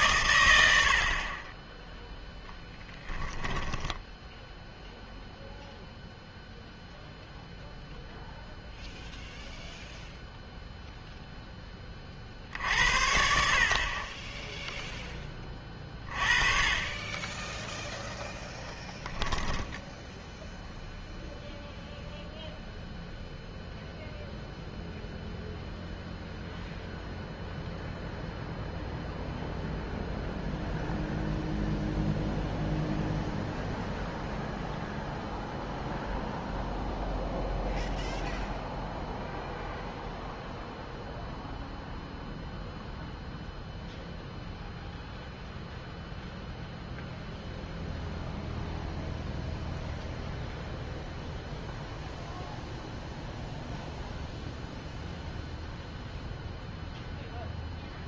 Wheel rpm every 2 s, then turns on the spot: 90, 10, 0, 0, 0, 0, 70, 10, 30, 10, 0, 0, 0, 0, 0, 0, 0, 0, 0, 0, 0, 0, 0, 0, 0, 0, 0, 0, 0.
none